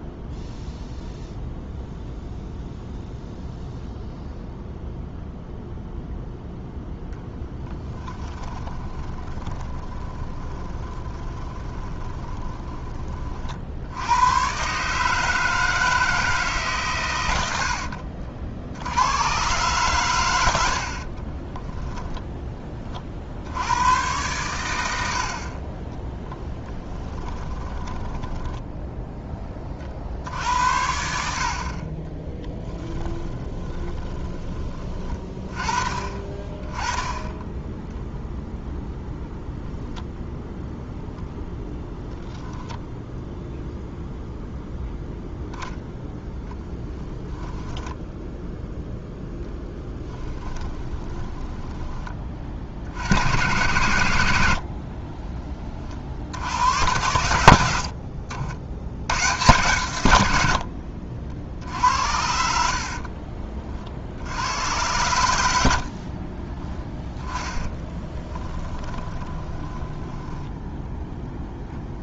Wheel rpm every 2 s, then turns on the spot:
0, 0, 0, 0, 20, 20, 20, 140, 130, 90, 60, 30, 90, 10, 10, 70, 10, 30, 20, 0, 0, 0, 0, 10, 0, 10, 60, 60, 90, 90, 70, 60, 100, 10, 10, 10.
8-12 20-22 26-30 32-34 50-52 54-56 62-64 68-70